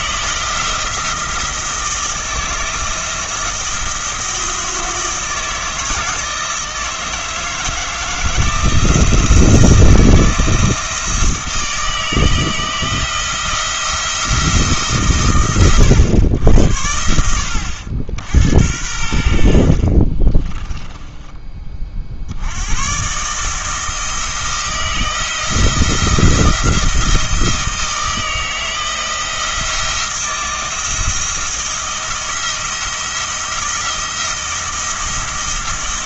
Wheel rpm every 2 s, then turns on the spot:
170, 160, 160, 160, 170, 160, 160, 130, 80, 80, 10, 100, 170, 170, 160, 170, 170, 170.
20-22